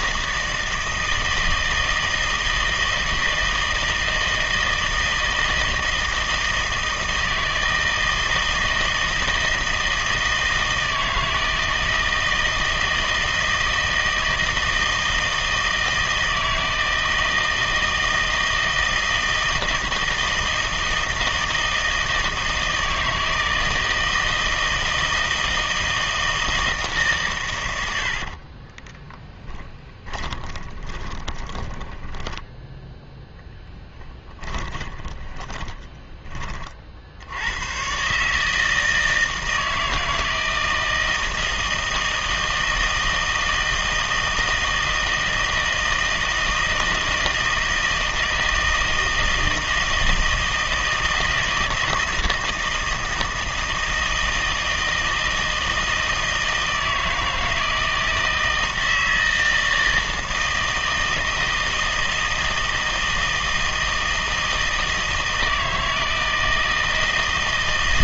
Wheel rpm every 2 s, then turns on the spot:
160, 160, 160, 160, 160, 160, 160, 160, 160, 160, 160, 160, 160, 160, 30, 20, 10, 30, 40, 160, 160, 160, 160, 160, 160, 160, 160, 160, 160, 160, 160, 160, 160, 160.
28-32 34-36